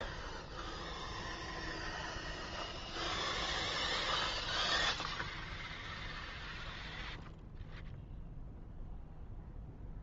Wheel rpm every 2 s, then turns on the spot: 0, 0, 0, 0, 0.
none